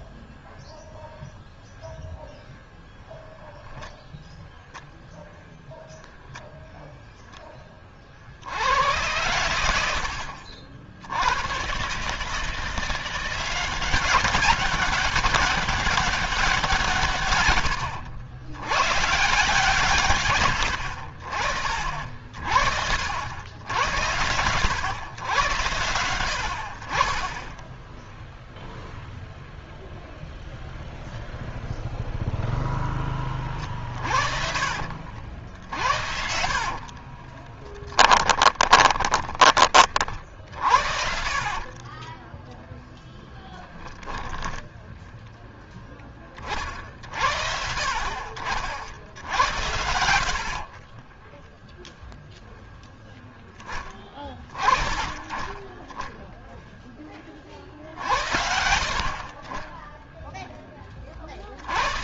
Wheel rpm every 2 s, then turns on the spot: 0, 0, 0, 0, 90, 60, 160, 190, 170, 120, 80, 50, 100, 60, 0, 0, 0, 50, 50, 10, 60, 10, 10, 30, 50, 50, 0, 30, 0, 80, 10.
36-40 42-44 50-52